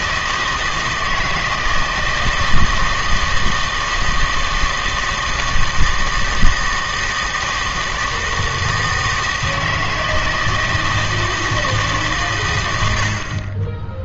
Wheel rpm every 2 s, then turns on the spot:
160, 160, 160, 160, 160, 160, 50.
none